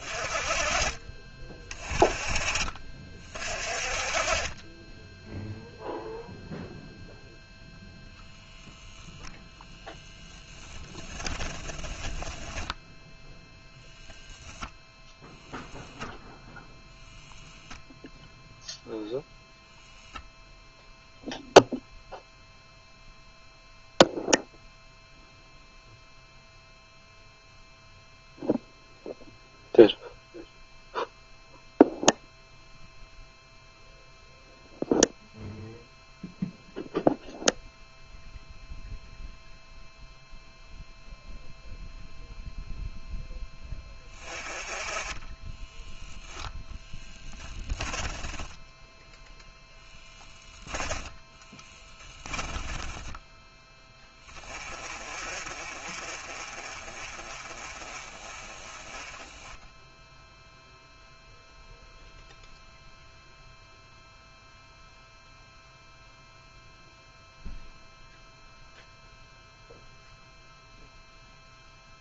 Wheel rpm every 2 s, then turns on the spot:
30, 30, 10, 0, 0, 10, 10, 0, 0, 0, 0, 0, 0, 0, 0, 0, 0, 0, 0, 0, 0, 0, 20, 0, 0, 10, 10, 30, 30, 20, 0, 0, 0, 0, 0, 0.
4-6 10-14 52-54